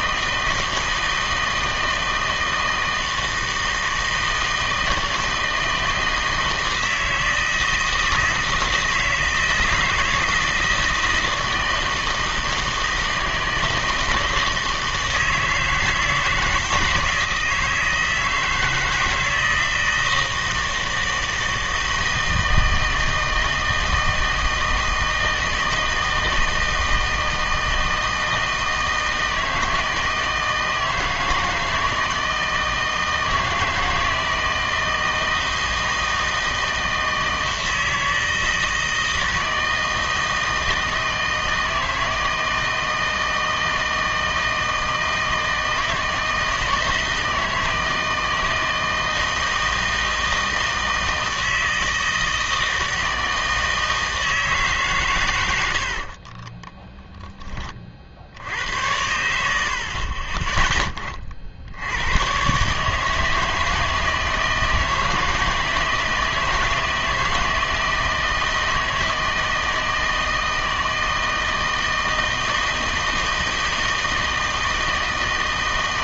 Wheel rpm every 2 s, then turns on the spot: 160, 160, 160, 160, 160, 160, 160, 160, 160, 160, 160, 160, 160, 160, 160, 160, 160, 160, 160, 160, 160, 160, 160, 160, 160, 160, 160, 150, 10, 80, 10, 140, 160, 160, 160, 160, 160, 160.
56-58